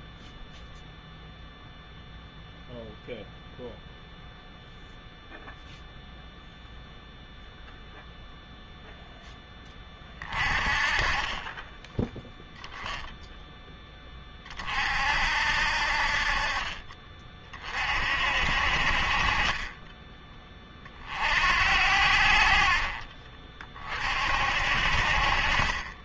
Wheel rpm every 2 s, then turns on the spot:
0, 0, 0, 0, 0, 30, 0, 40, 40, 60, 30, 60, 60.
none